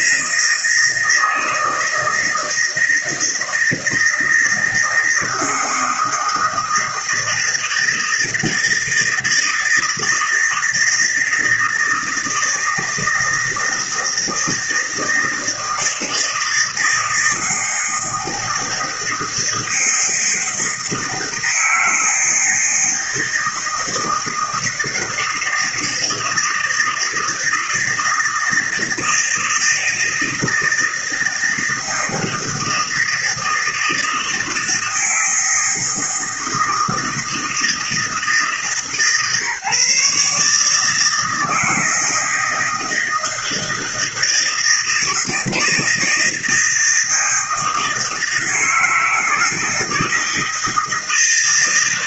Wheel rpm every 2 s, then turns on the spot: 160, 160, 170, 160, 160, 160, 160, 160, 160, 160, 160, 160, 160, 160, 160, 160, 160, 160, 160, 150, 150, 160, 160, 160, 160, 160.
none